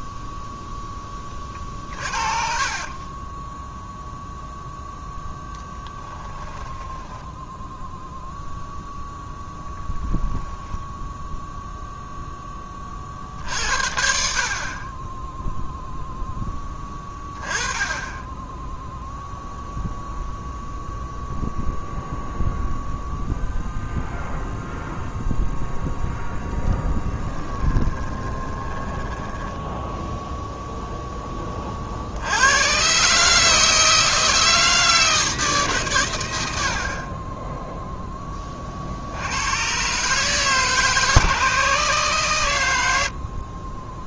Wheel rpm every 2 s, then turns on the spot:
0, 40, 0, 20, 0, 0, 20, 40, 10, 10, 0, 0, 0, 20, 10, 0, 110, 160, 70, 40, 150, 100.
2-4 6-8 26-30